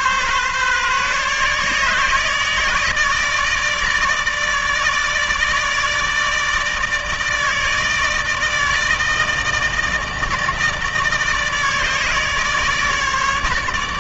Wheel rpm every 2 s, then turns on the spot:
140, 150, 150, 160, 160, 160, 150.
none